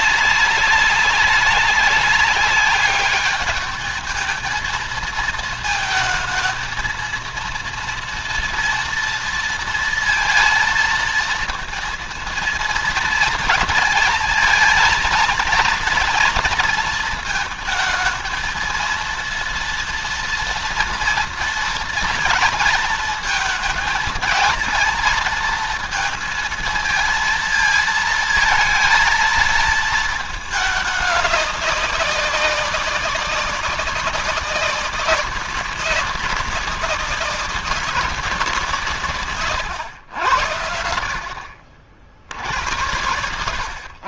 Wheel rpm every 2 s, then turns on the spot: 200, 200, 220, 230, 230, 230, 230, 220, 220, 230, 230, 220, 230, 220, 230, 210, 200, 200, 190, 170, 70, 80.
none